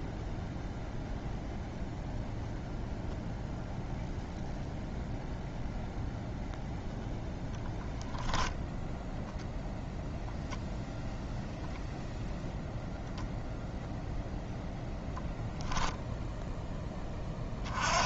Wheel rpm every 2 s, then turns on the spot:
0, 0, 0, 0, 0, 0, 0, 10, 20.
none